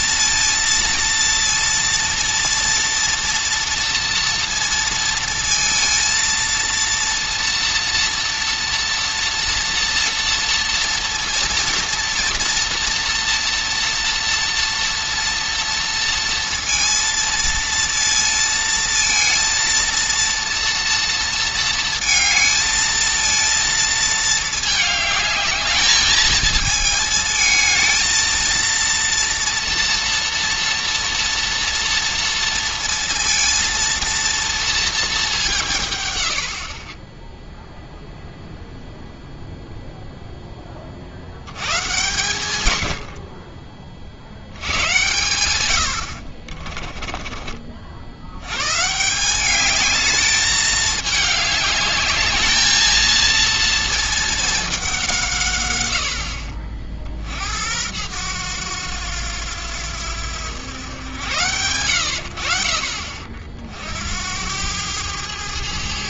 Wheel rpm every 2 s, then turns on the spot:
230, 230, 230, 230, 240, 230, 230, 230, 230, 230, 240, 220, 210, 220, 230, 230, 230, 230, 50, 0, 20, 100, 110, 40, 140, 210, 220, 190, 50, 100, 100, 70, 100.
46-48